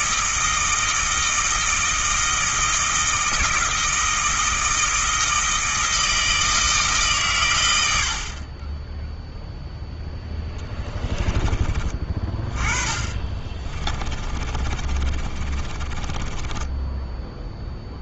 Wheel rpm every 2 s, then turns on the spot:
160, 160, 160, 150, 10, 10, 30, 30, 10.
10-18